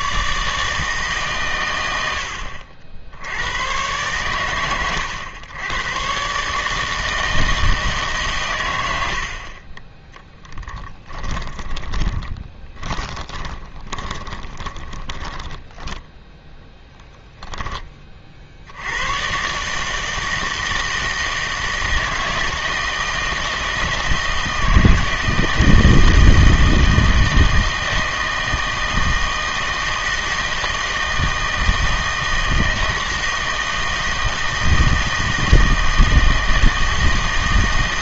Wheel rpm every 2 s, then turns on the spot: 150, 70, 100, 160, 100, 10, 20, 10, 10, 80, 160, 160, 160, 160, 160, 160, 160, 160, 160.
8-16